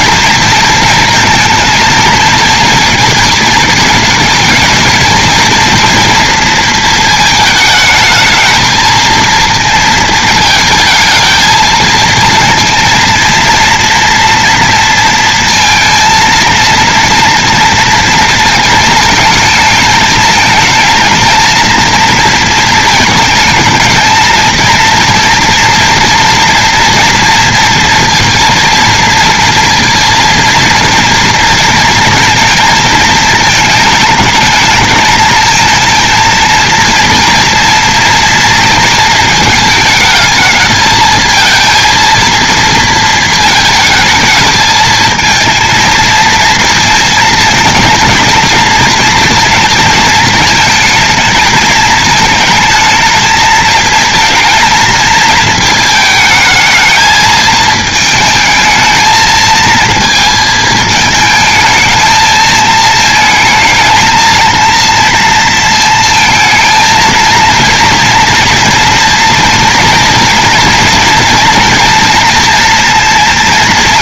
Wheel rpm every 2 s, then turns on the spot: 230, 230, 220, 220, 220, 220, 230, 230, 230, 220, 220, 220, 230, 230, 230, 230, 220, 210, 230, 230, 220, 230, 220, 220, 230, 220, 220, 220, 220, 220, 220, 220, 230, 230, 230, 230, 230.
none